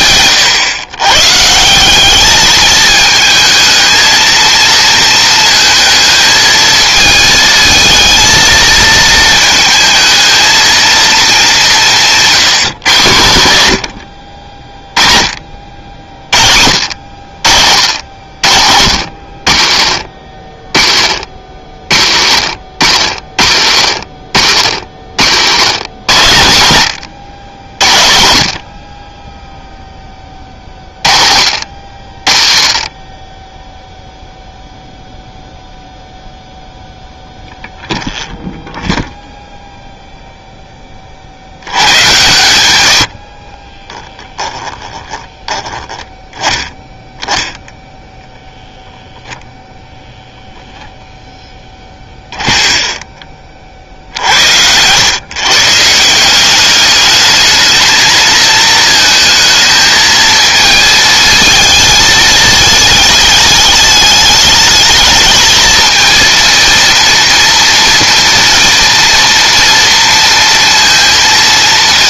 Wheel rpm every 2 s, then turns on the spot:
110, 210, 230, 220, 220, 220, 150, 40, 70, 70, 40, 50, 60, 110, 50, 30, 30, 0, 0, 0, 10, 100, 10, 0, 0, 10, 10, 100, 200, 230, 220, 210, 220, 230, 240, 230.
44-46